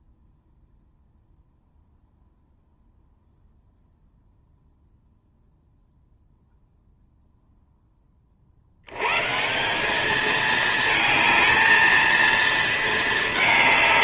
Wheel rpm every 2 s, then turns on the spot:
0, 0, 0, 0, 90, 220, 220.
none